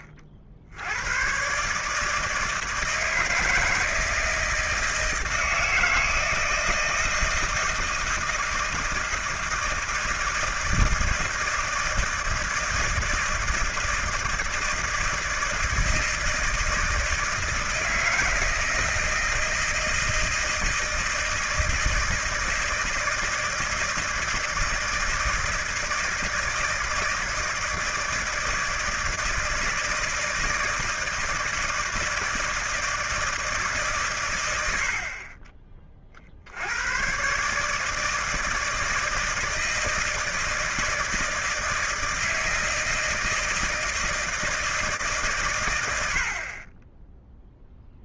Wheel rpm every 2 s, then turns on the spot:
70, 160, 160, 160, 160, 160, 160, 160, 160, 160, 160, 160, 160, 160, 160, 160, 160, 80, 70, 160, 160, 160, 160, 20.
none